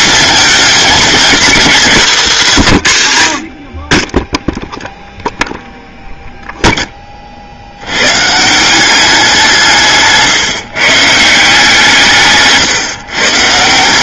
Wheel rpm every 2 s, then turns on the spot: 240, 140, 0, 10, 190, 140, 150.
none